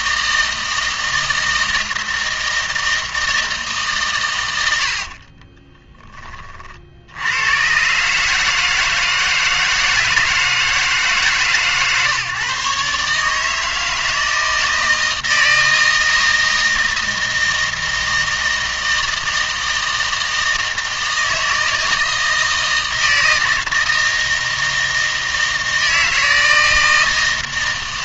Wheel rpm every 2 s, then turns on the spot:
160, 160, 90, 60, 160, 160, 140, 160, 160, 160, 160, 160, 160, 160.
4-6